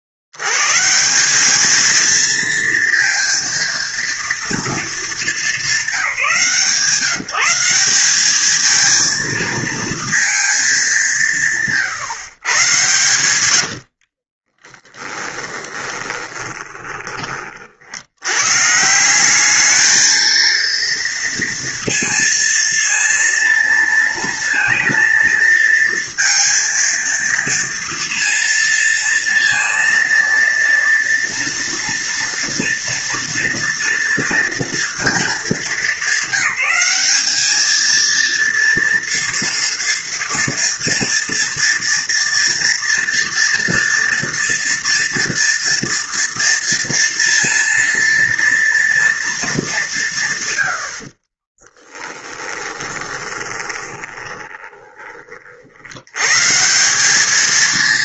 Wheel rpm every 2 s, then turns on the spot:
60, 230, 230, 180, 210, 220, 120, 20, 20, 110, 220, 230, 230, 230, 230, 230, 230, 230, 200, 230, 230, 230, 230, 230, 230, 130, 10, 20, 150.
14-18 52-56